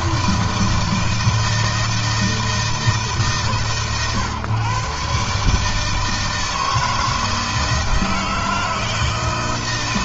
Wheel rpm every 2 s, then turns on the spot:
160, 160, 130, 160, 160.
none